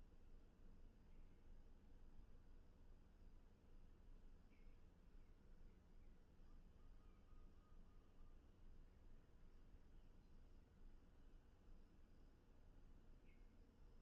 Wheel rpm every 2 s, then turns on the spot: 0, 0, 0, 0, 0, 0, 0.
none